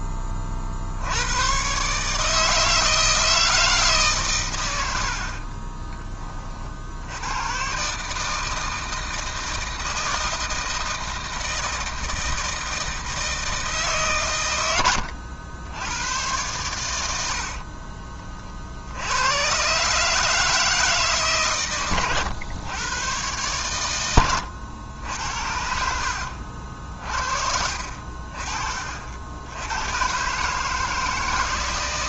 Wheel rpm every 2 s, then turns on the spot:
60, 160, 90, 80, 160, 160, 160, 90, 100, 70, 160, 110, 90, 50, 40, 160.
4-6 14-16